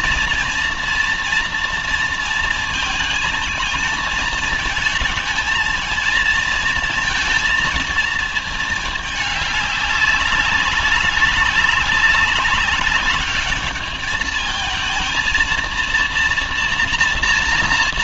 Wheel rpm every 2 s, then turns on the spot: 230, 230, 220, 230, 220, 200, 190, 220, 230.
none